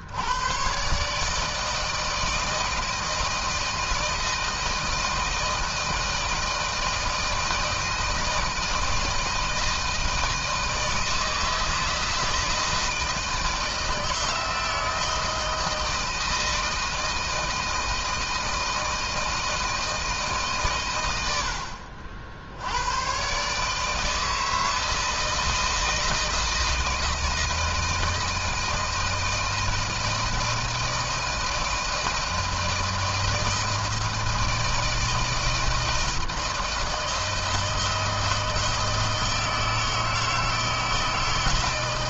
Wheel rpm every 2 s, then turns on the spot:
100, 160, 160, 160, 160, 160, 160, 160, 160, 160, 150, 70, 160, 160, 160, 160, 160, 160, 160, 160, 160.
none